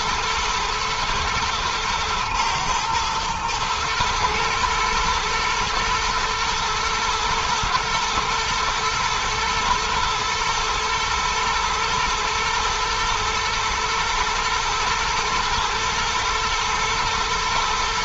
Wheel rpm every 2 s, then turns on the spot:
110, 110, 120, 120, 110, 110, 110, 120, 110.
none